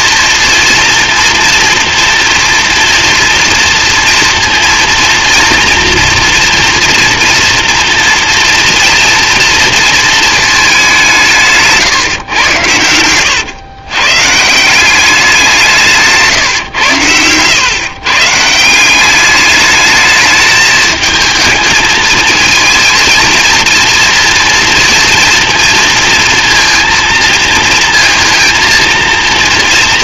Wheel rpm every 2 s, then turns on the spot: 230, 230, 230, 230, 230, 210, 100, 180, 130, 170, 220, 230, 230, 230, 230.
none